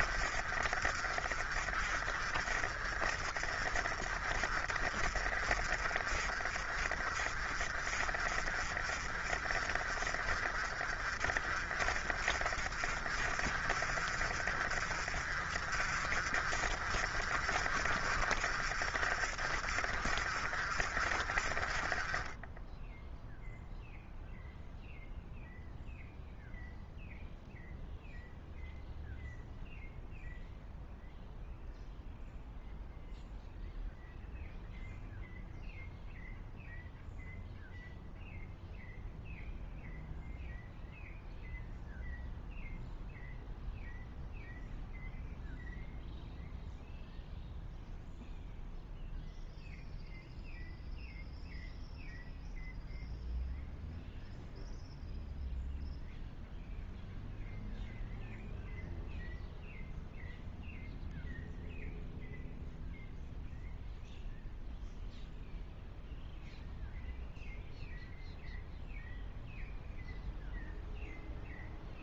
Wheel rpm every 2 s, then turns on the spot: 40, 40, 40, 50, 40, 40, 40, 50, 50, 50, 50, 10, 0, 0, 0, 0, 0, 0, 0, 0, 0, 0, 0, 0, 0, 0, 0, 0, 0, 0, 0, 0, 0, 0, 0, 0.
none